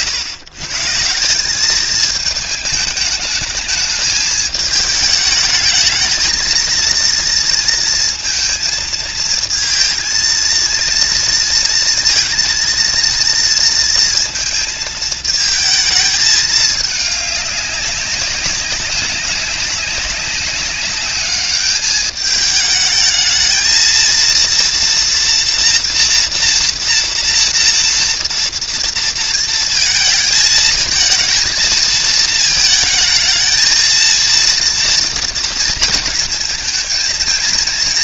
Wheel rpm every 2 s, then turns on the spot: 120, 210, 210, 230, 230, 230, 230, 230, 210, 190, 200, 210, 230, 230, 230, 220, 220, 230, 230.
none